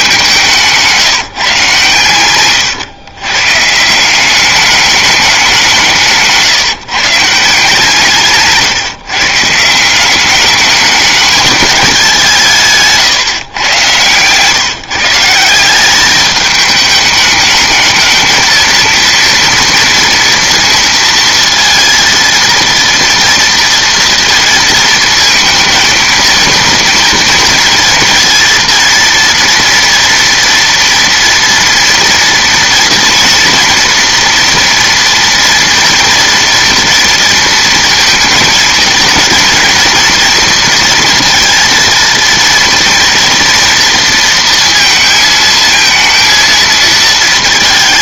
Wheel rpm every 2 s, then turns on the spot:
180, 120, 200, 140, 140, 210, 150, 140, 210, 230, 230, 230, 230, 230, 230, 240, 230, 240, 240, 230, 230, 230, 230, 230.
none